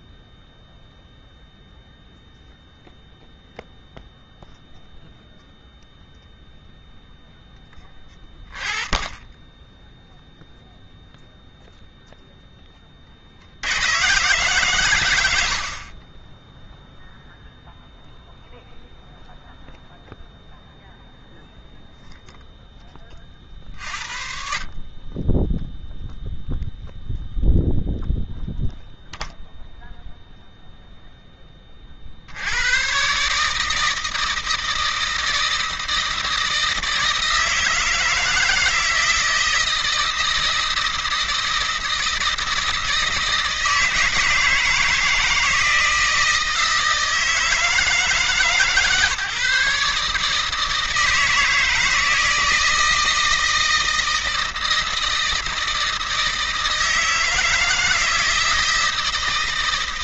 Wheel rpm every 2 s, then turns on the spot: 0, 0, 0, 0, 30, 0, 20, 120, 0, 0, 0, 10, 50, 0, 0, 0, 90, 160, 160, 160, 160, 160, 160, 160, 140, 160, 160, 160, 160, 160.
none